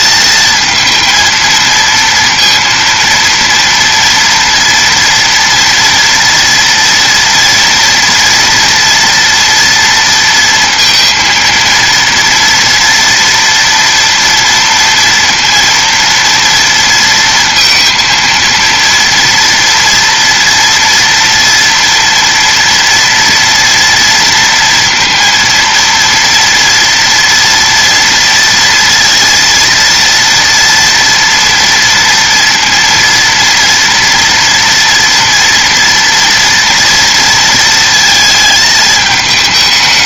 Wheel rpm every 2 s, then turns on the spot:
220, 230, 230, 230, 240, 230, 230, 230, 230, 230, 230, 240, 230, 230, 230, 230, 230, 230, 230, 220.
none